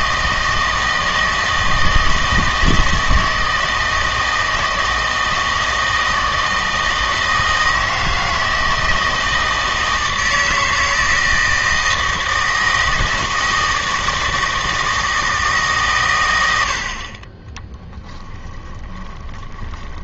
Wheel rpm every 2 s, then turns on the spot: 160, 160, 160, 160, 160, 160, 160, 160, 80, 20.
18-20